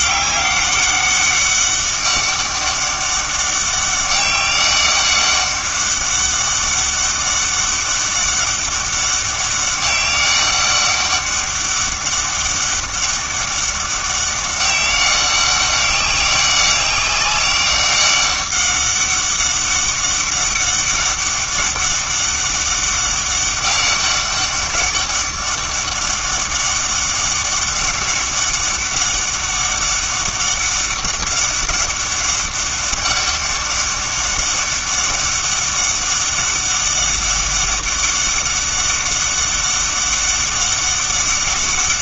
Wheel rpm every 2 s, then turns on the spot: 200, 200, 200, 200, 200, 200, 200, 200, 190, 200, 200, 200, 200, 200, 200, 190, 200, 200, 200, 200, 200.
none